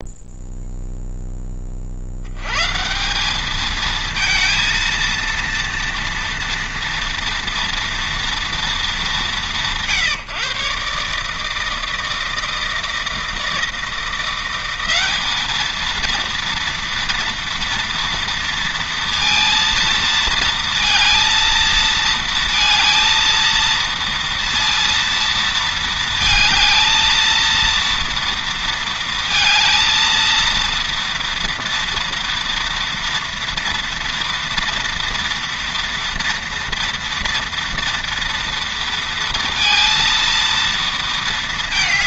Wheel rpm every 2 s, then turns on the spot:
0, 140, 230, 230, 220, 140, 160, 190, 230, 230, 230, 230, 230, 220, 230, 230, 230, 230, 240, 230, 230.
none